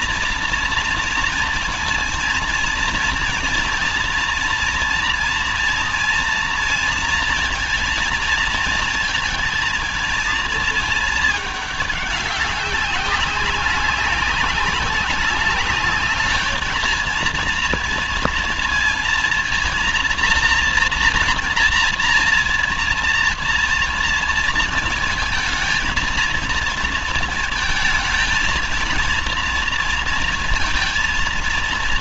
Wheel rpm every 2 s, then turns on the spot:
230, 230, 240, 230, 230, 220, 200, 190, 220, 230, 240, 230, 230, 230, 220, 230.
none